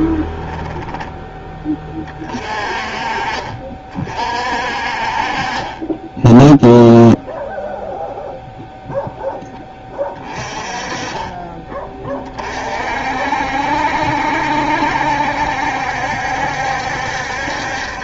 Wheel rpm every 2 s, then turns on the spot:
10, 40, 40, 0, 0, 30, 50, 70, 70.
0-2 10-12